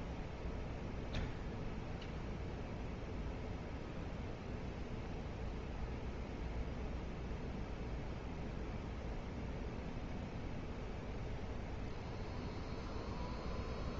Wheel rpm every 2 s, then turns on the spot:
0, 0, 0, 0, 0, 0, 0.
none